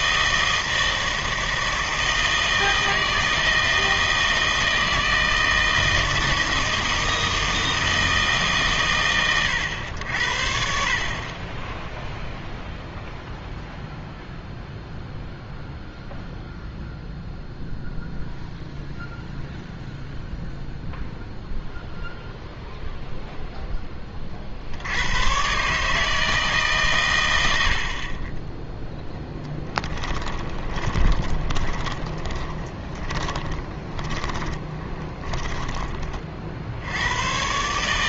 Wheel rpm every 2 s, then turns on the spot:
160, 160, 160, 160, 130, 50, 0, 0, 0, 0, 0, 0, 60, 140, 10, 20, 30, 20, 60.
30-36